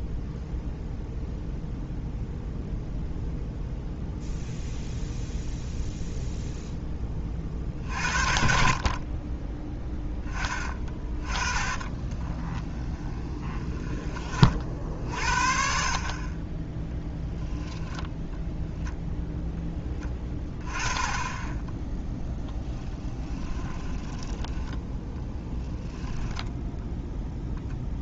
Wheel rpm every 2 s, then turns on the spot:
0, 0, 0, 10, 40, 20, 20, 50, 10, 0, 20, 10, 10, 0.
10-14 22-24